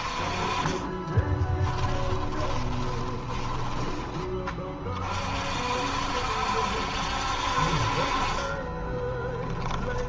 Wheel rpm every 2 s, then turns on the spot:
20, 30, 40, 60, 10.
0-4 8-10